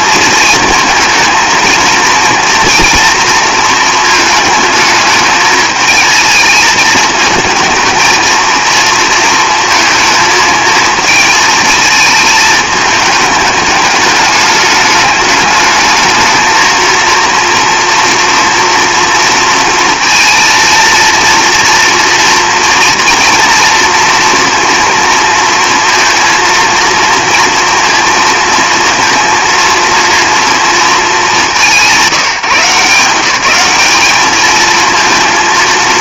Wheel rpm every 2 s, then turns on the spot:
230, 230, 220, 220, 230, 220, 220, 210, 220, 230, 230, 230, 240, 230, 230, 230, 170, 220.
none